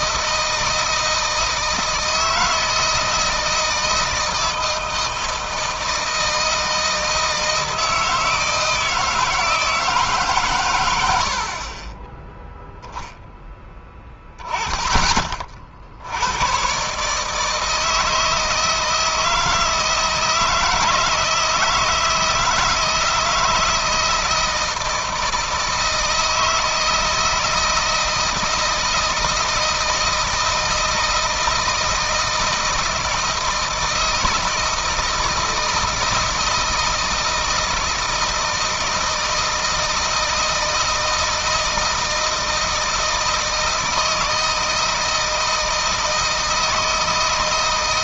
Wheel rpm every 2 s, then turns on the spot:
160, 160, 160, 160, 160, 120, 0, 10, 120, 160, 160, 160, 160, 160, 160, 160, 160, 160, 160, 160, 160, 160, 160, 160.
none